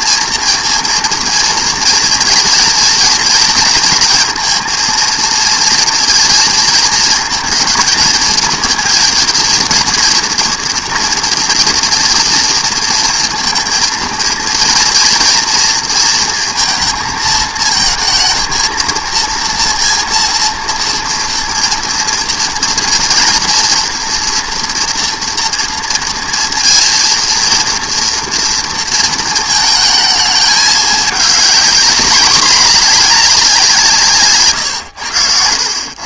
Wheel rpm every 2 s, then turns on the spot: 230, 230, 230, 230, 230, 230, 230, 230, 230, 220, 230, 230, 230, 230, 230, 220, 220, 130.
34-36